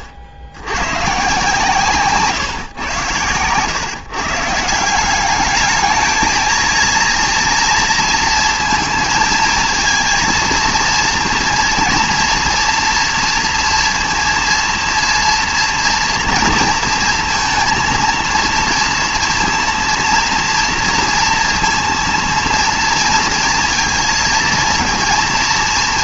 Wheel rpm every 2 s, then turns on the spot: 90, 110, 170, 230, 230, 230, 230, 230, 230, 240, 230, 230, 230.
none